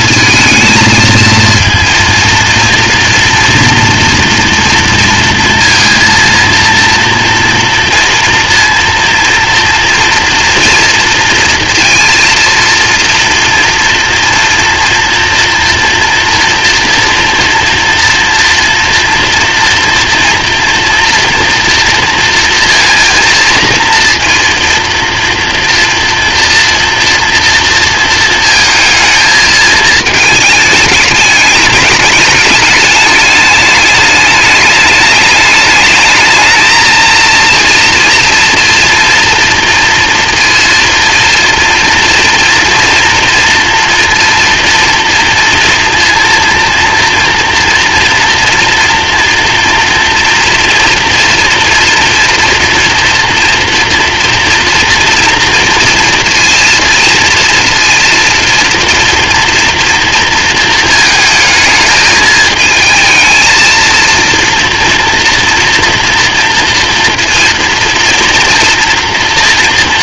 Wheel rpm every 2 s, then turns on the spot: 230, 230, 230, 230, 230, 230, 230, 240, 230, 230, 230, 230, 230, 230, 220, 210, 210, 210, 220, 230, 230, 230, 230, 230, 230, 230, 230, 230, 230, 230, 220, 220, 230, 230, 230.
none